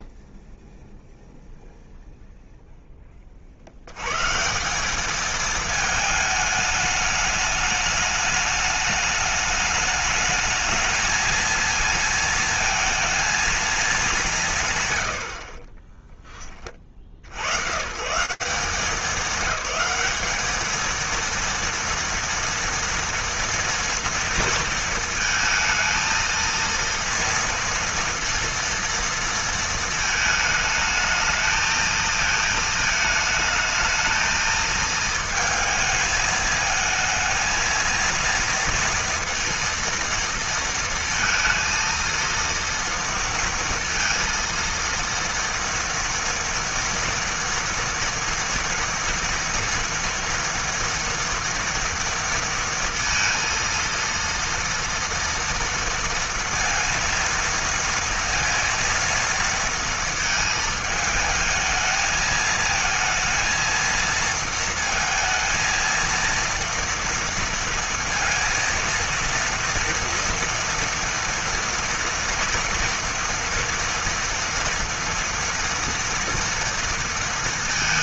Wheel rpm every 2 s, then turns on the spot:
0, 0, 190, 210, 210, 220, 230, 110, 70, 210, 230, 230, 230, 230, 230, 220, 220, 220, 230, 230, 230, 230, 240, 230, 240, 240, 230, 230, 230, 230, 220, 230, 230, 230, 230, 230, 230, 230, 230.
none